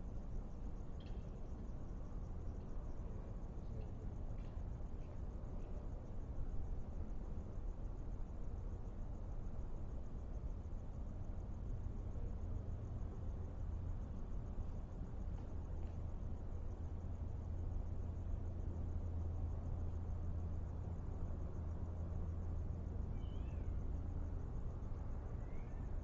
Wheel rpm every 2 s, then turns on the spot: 0, 0, 0, 0, 0, 0, 0, 0, 0, 0, 0, 0, 0.
none